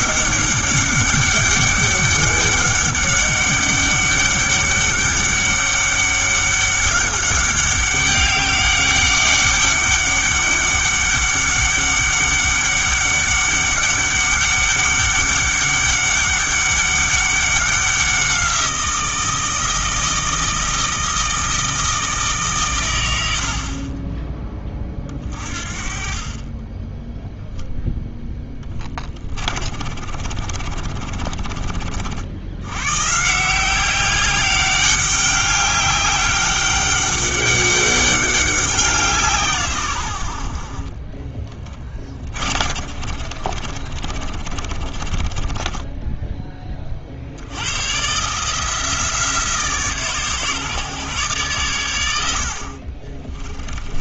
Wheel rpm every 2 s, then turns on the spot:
200, 200, 200, 200, 200, 200, 200, 200, 200, 180, 160, 130, 30, 20, 20, 40, 90, 190, 200, 190, 50, 40, 40, 20, 150, 140, 60.
28-32 42-46